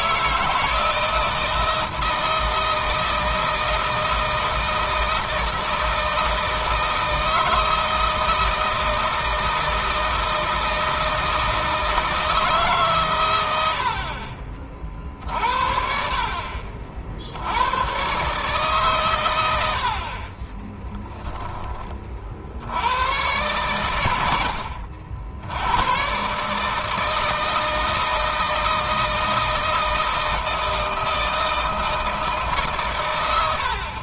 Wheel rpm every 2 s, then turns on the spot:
170, 160, 160, 160, 160, 160, 150, 50, 50, 130, 20, 70, 80, 150, 160, 160, 130.
20-22